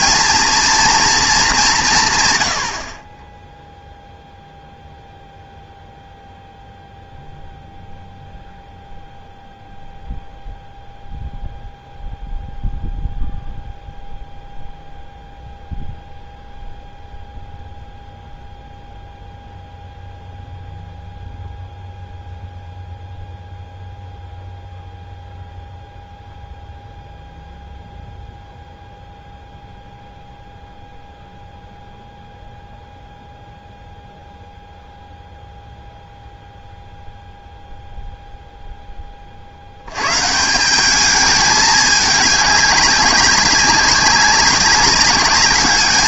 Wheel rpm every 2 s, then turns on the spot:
230, 90, 0, 0, 0, 0, 0, 0, 0, 0, 0, 0, 0, 0, 0, 0, 0, 0, 0, 0, 190, 200, 200.
none